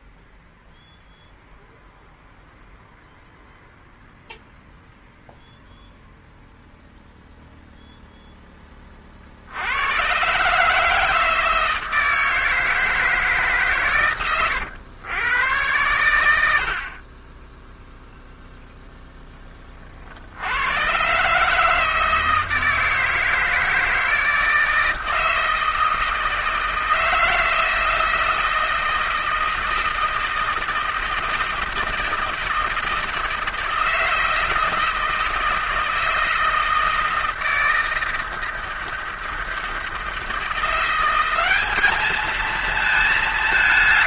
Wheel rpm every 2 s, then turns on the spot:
0, 0, 0, 0, 20, 140, 160, 100, 70, 0, 90, 160, 160, 160, 160, 160, 160, 160, 160, 160, 170, 220.
none